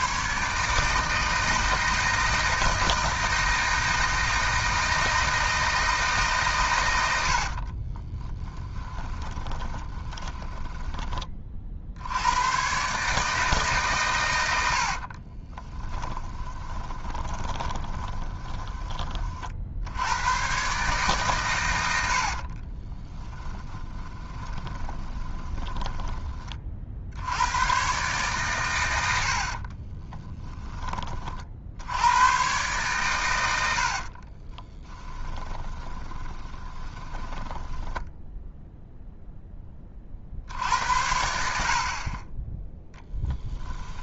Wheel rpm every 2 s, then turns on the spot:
150, 160, 160, 110, 10, 20, 140, 60, 20, 20, 140, 30, 20, 50, 110, 20, 120, 20, 20, 0, 70, 10.
8-10 14-18 22-26 30-32 34-38